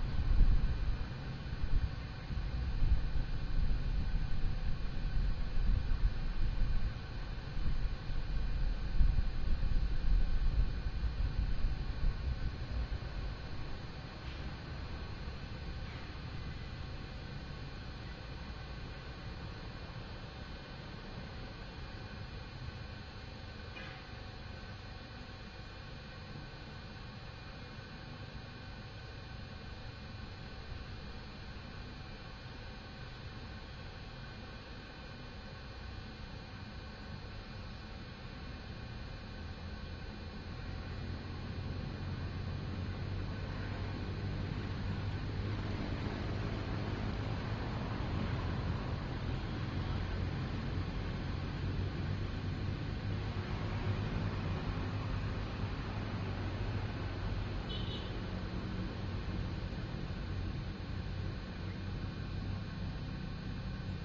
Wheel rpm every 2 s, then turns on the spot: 0, 0, 0, 0, 0, 0, 0, 0, 0, 0, 0, 0, 0, 0, 0, 0, 0, 0, 0, 0, 0, 0, 0, 0, 0, 0, 0, 0, 0, 0, 0, 0.
none